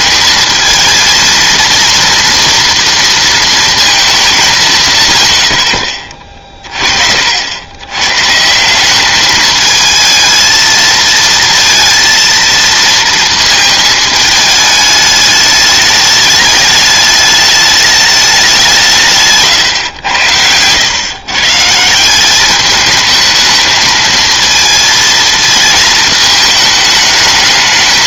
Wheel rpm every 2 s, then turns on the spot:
220, 230, 180, 40, 170, 220, 230, 210, 210, 190, 110, 210, 230, 220.
none